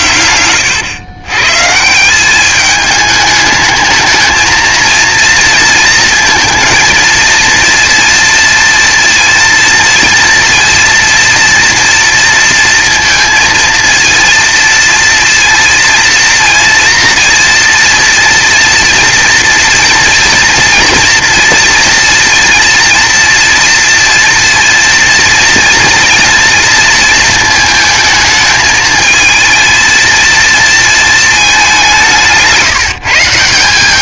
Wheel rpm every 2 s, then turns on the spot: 110, 210, 230, 230, 230, 230, 230, 230, 230, 230, 240, 220, 230, 230, 220, 230, 150.
none